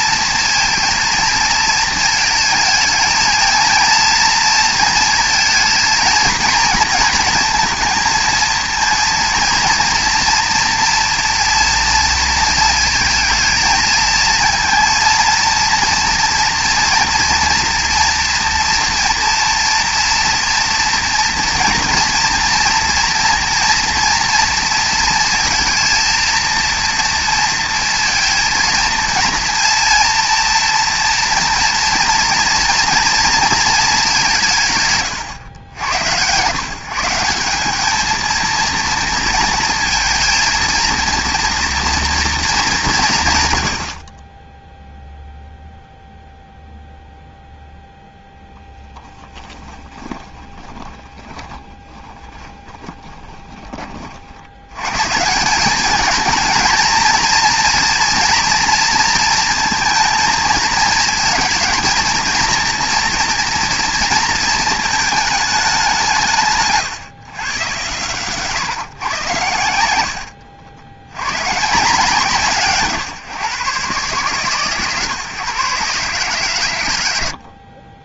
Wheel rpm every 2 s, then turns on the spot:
230, 220, 230, 230, 230, 230, 230, 230, 230, 230, 230, 230, 230, 230, 230, 230, 230, 170, 130, 230, 230, 210, 10, 0, 0, 20, 20, 80, 220, 240, 230, 230, 230, 140, 120, 80, 150, 140, 120.
50-54 70-72